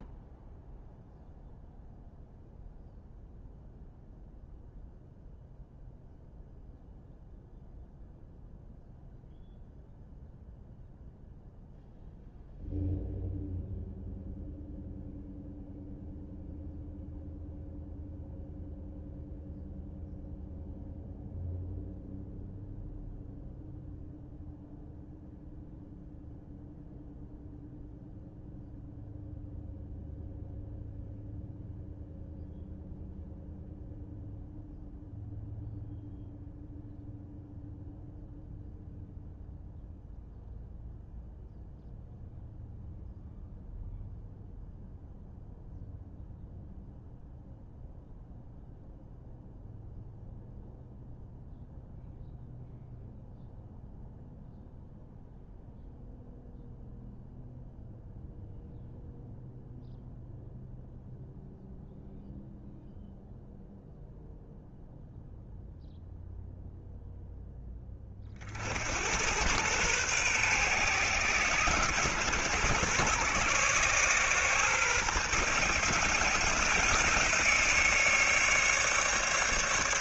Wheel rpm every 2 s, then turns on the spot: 0, 0, 0, 0, 0, 0, 0, 0, 0, 0, 0, 0, 0, 0, 0, 0, 0, 0, 0, 0, 0, 0, 0, 0, 0, 0, 0, 0, 0, 0, 0, 0, 0, 0, 70, 120, 120, 130, 150, 150.
none